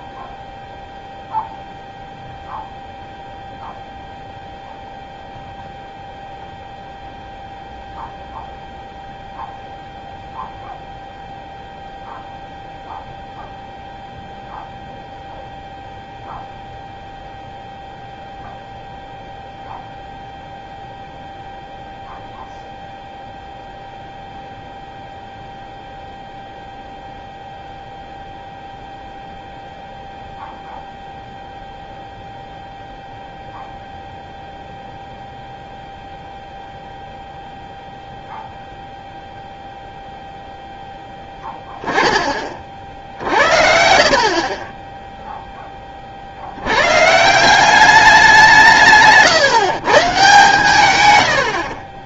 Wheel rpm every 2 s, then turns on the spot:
0, 0, 0, 0, 0, 0, 0, 0, 0, 0, 0, 0, 0, 0, 0, 0, 0, 0, 0, 0, 0, 40, 40, 90, 160, 140.
none